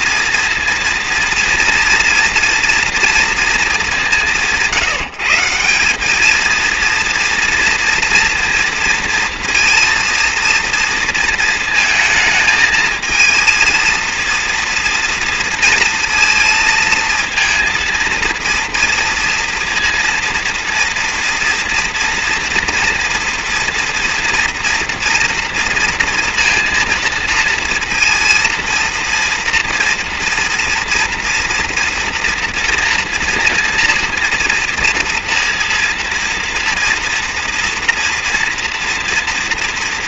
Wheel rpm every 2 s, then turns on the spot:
230, 230, 170, 230, 230, 230, 220, 230, 230, 230, 230, 240, 230, 230, 230, 240, 230, 230, 230, 230.
none